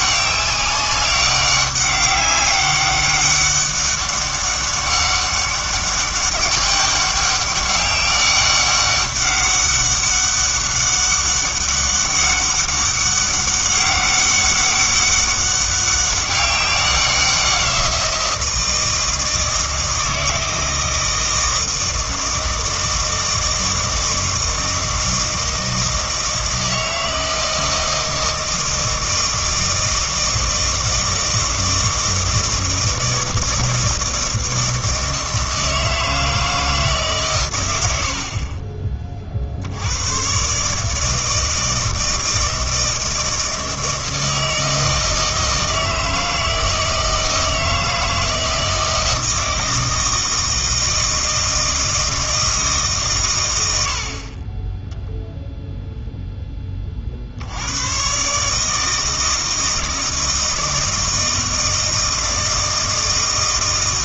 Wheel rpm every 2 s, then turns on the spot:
200, 200, 200, 200, 200, 190, 200, 200, 190, 170, 160, 160, 160, 160, 160, 160, 160, 160, 160, 40, 140, 160, 160, 160, 160, 160, 160, 20, 20, 150, 160, 160.
none